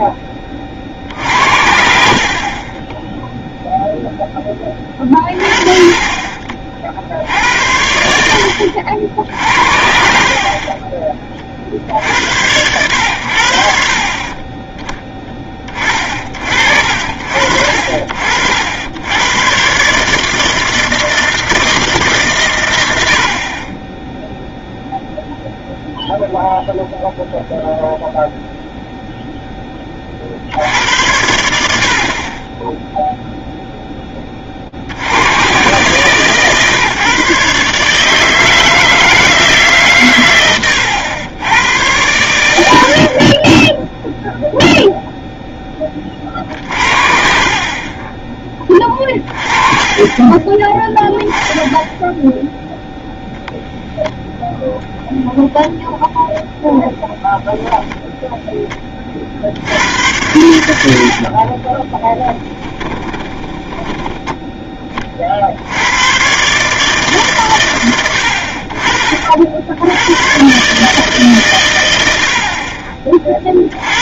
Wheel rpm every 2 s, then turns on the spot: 40, 40, 20, 40, 70, 30, 90, 30, 60, 70, 160, 110, 0, 0, 0, 80, 10, 50, 130, 160, 100, 80, 0, 50, 20, 10, 0, 0, 0, 10, 80, 10, 10, 150, 60, 130, 30.
14-16 40-42 62-64